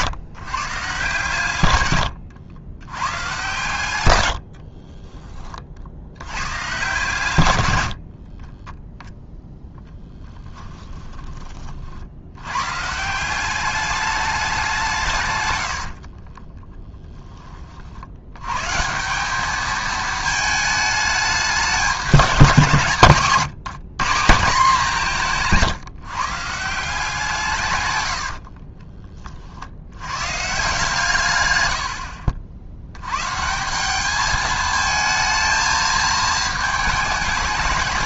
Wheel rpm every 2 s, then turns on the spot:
150, 90, 50, 120, 20, 20, 120, 190, 20, 130, 210, 170, 180, 170, 60, 140, 80, 220, 220.
4-6 8-12 16-18 28-30